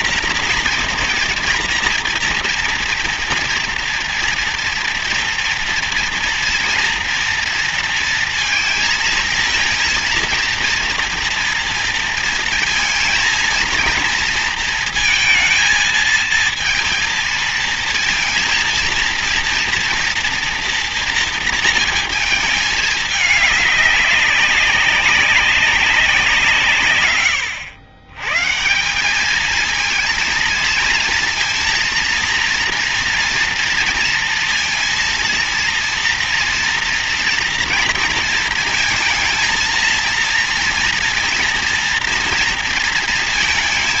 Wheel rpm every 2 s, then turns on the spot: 230, 230, 230, 230, 230, 230, 230, 230, 230, 240, 240, 220, 200, 160, 140, 230, 230, 230, 230, 230, 230, 230.
none